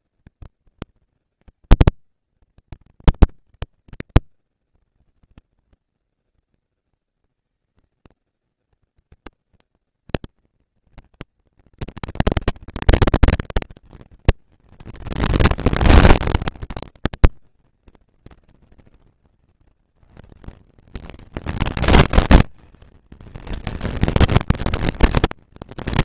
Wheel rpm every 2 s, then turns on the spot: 230, 230, 230, 230, 230, 230, 230, 220, 200, 190, 210, 220, 230.
none